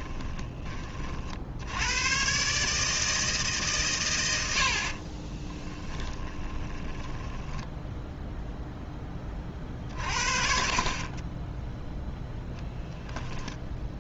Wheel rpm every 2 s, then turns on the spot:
30, 150, 60, 10, 10, 40, 0.
4-8